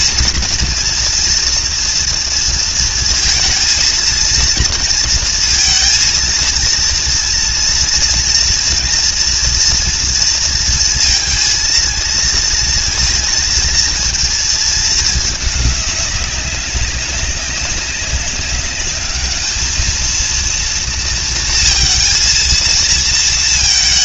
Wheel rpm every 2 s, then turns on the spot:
240, 230, 230, 230, 240, 230, 230, 220, 200, 210, 230, 230.
none